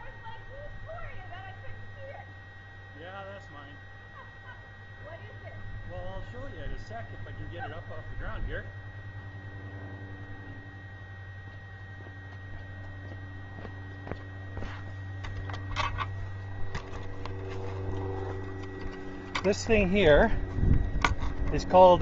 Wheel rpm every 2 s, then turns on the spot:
0, 0, 0, 0, 0, 0, 0, 0, 0, 0, 0.
none